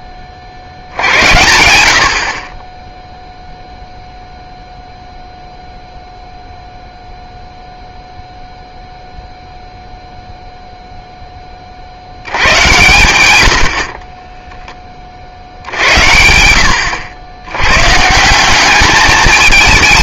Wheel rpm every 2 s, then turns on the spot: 80, 0, 0, 0, 0, 0, 100, 40, 100, 210.
none